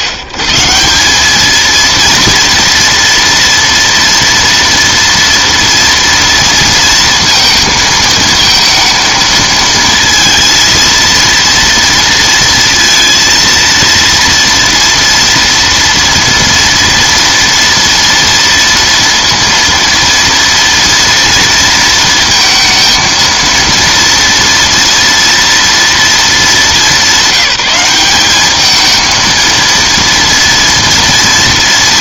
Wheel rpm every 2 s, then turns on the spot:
120, 230, 230, 230, 220, 230, 230, 230, 230, 230, 230, 230, 230, 210, 210, 230.
none